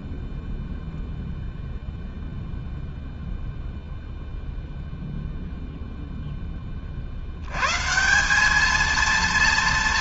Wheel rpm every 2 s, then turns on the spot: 0, 0, 0, 120, 230.
none